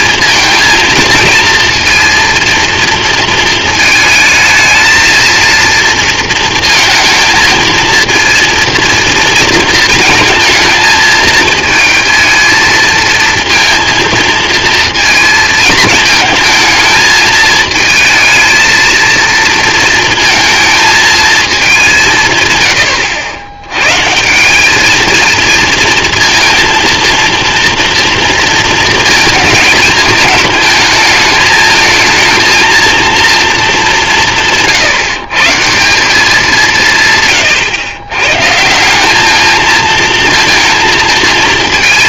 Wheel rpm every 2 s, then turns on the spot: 230, 230, 220, 220, 230, 220, 230, 230, 220, 230, 220, 100, 210, 230, 220, 220, 230, 160, 170, 170, 230.
none